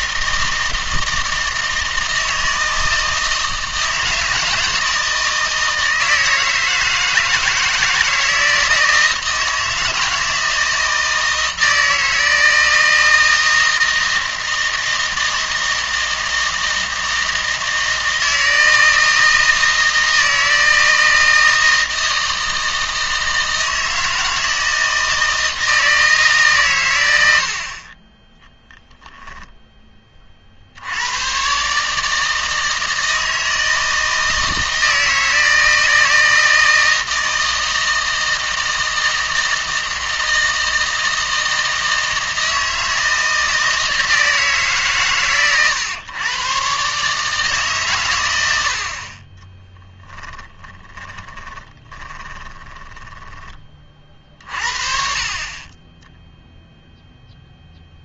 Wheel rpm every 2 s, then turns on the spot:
160, 160, 160, 160, 160, 160, 160, 160, 160, 160, 160, 160, 160, 120, 10, 70, 160, 160, 160, 160, 160, 160, 140, 130, 70, 20, 20, 40, 0.
50-54